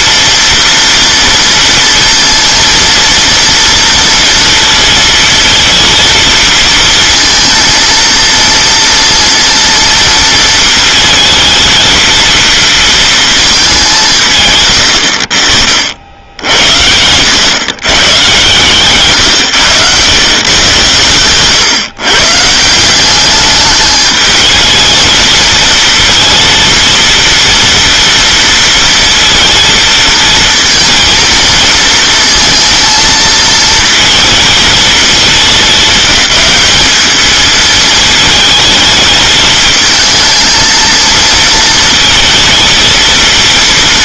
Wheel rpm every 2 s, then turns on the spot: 230, 230, 230, 230, 230, 230, 220, 110, 80, 140, 120, 170, 220, 230, 230, 230, 230, 220, 200, 220, 230, 230.
none